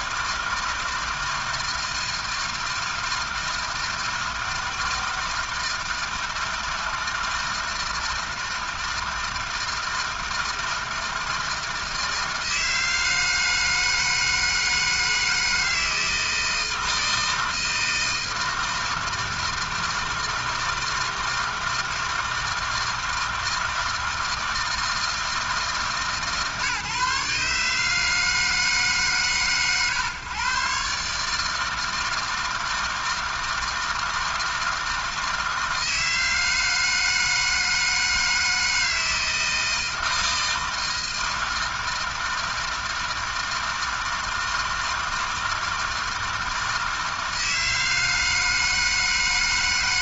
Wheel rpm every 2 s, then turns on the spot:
160, 160, 160, 160, 160, 160, 160, 160, 160, 160, 160, 160, 160, 150, 150, 130, 160, 160, 160, 160, 160, 160, 160, 160, 160.
none